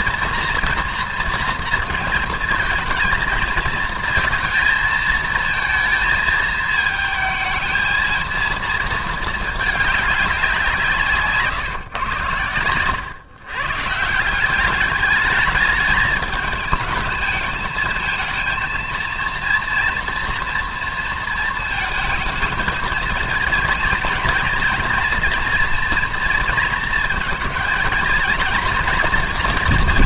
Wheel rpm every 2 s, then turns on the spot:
230, 230, 230, 220, 220, 160, 110, 200, 220, 230, 230, 230, 240, 230, 230.
none